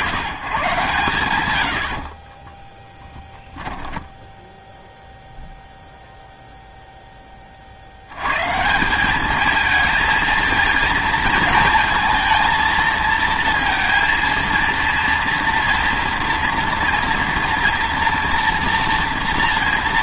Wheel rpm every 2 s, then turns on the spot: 120, 20, 0, 0, 150, 230, 230, 230, 240, 230.
2-4